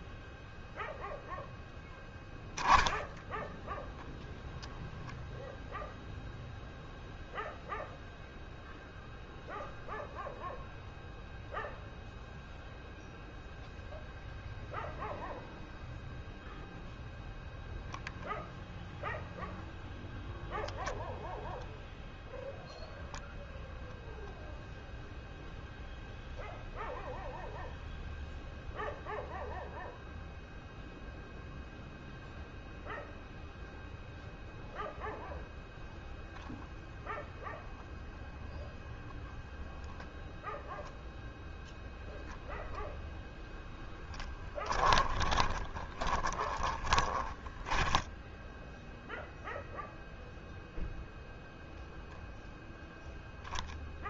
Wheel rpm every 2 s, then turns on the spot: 0, 0, 0, 0, 0, 0, 0, 0, 0, 0, 0, 0, 0, 0, 0, 0, 0, 0, 0, 0, 0, 0, 10, 20, 10, 0, 0.
44-48